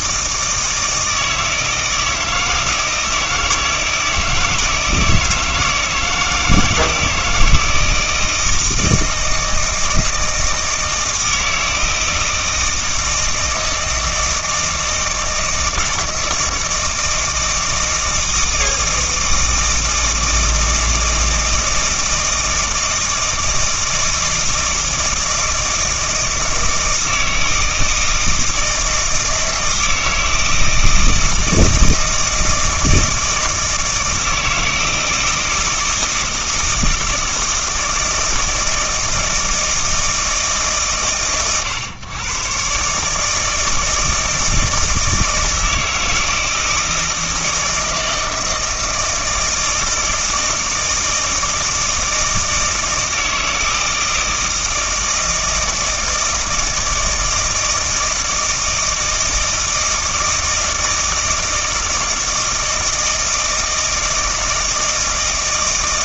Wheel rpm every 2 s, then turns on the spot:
160, 160, 160, 160, 160, 160, 160, 160, 160, 160, 160, 160, 160, 160, 160, 160, 160, 160, 160, 160, 120, 140, 160, 160, 160, 160, 160, 160, 160, 160, 160, 160, 160.
none